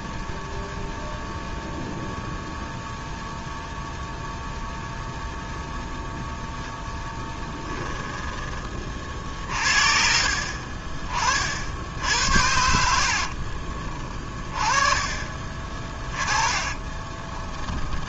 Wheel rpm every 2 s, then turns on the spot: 0, 0, 0, 10, 30, 40, 60, 30, 20.
12-14 16-18